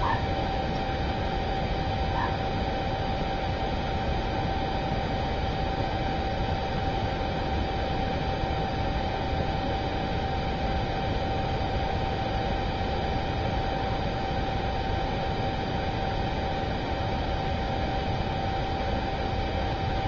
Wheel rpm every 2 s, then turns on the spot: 0, 0, 0, 0, 0, 0, 0, 0, 0, 0.
none